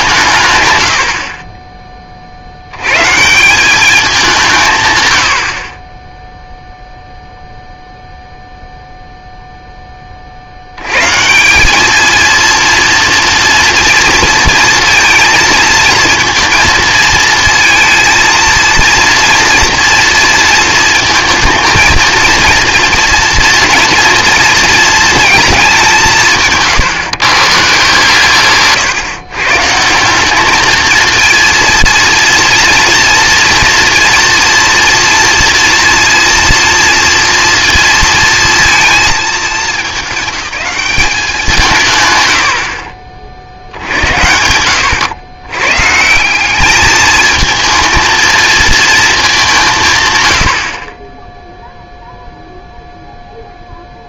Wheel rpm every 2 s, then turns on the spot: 110, 80, 150, 0, 0, 80, 230, 230, 230, 230, 220, 230, 230, 150, 130, 220, 230, 230, 230, 230, 210, 50, 90, 200, 230, 50, 0.
none